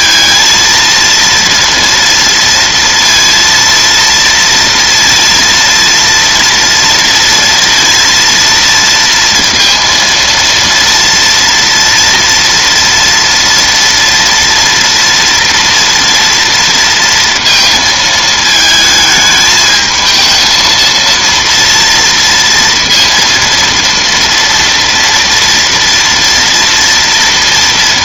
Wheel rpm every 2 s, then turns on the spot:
230, 230, 230, 230, 230, 230, 230, 230, 230, 220, 230, 230, 240, 230.
none